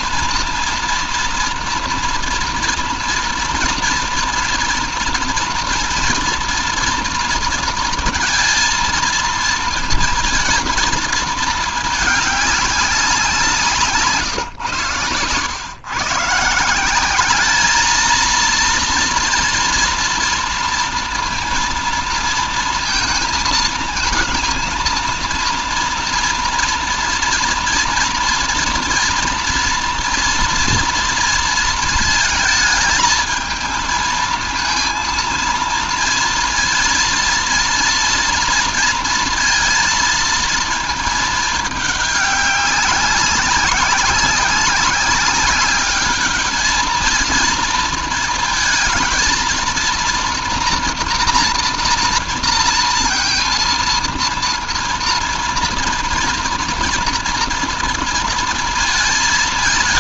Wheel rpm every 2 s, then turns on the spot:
230, 230, 240, 230, 230, 220, 190, 120, 200, 230, 230, 230, 230, 230, 230, 230, 220, 230, 230, 230, 220, 200, 200, 220, 230, 240, 230, 230, 240, 220.
none